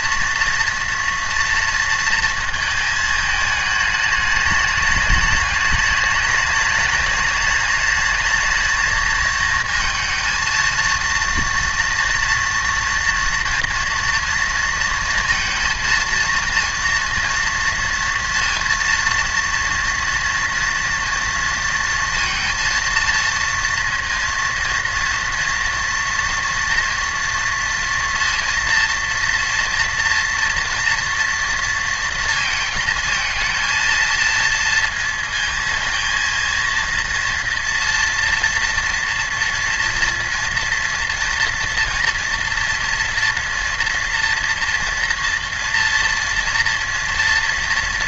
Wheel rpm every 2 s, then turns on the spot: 230, 220, 210, 210, 220, 230, 240, 230, 230, 230, 230, 230, 230, 230, 230, 230, 230, 230, 230, 240, 230, 230, 230, 230.
none